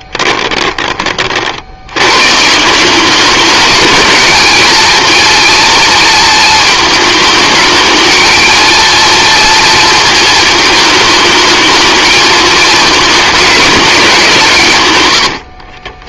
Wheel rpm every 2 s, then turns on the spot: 30, 180, 230, 220, 230, 220, 220, 120.
none